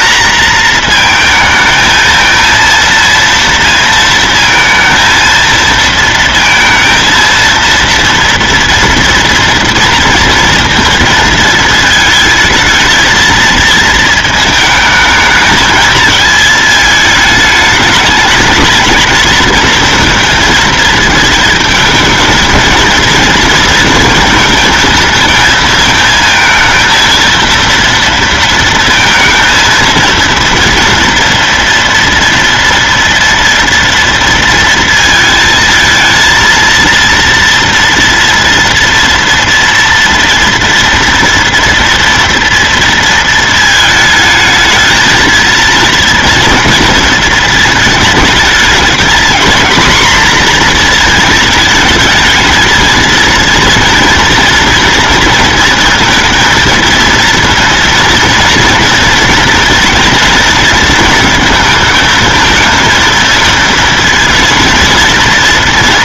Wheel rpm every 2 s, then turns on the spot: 230, 230, 230, 230, 230, 230, 220, 220, 220, 210, 220, 230, 230, 220, 230, 230, 230, 230, 230, 230, 230, 230, 220, 230, 220, 230, 220, 230, 230, 230, 230, 220, 220.
none